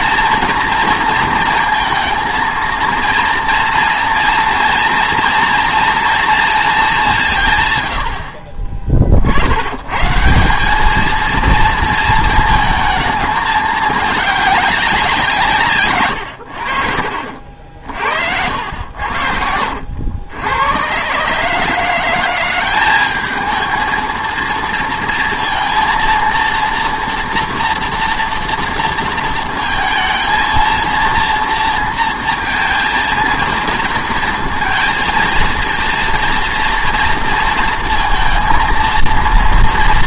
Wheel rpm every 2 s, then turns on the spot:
230, 230, 240, 210, 30, 190, 220, 200, 60, 80, 100, 190, 230, 230, 230, 230, 230, 230, 230, 230.
18-20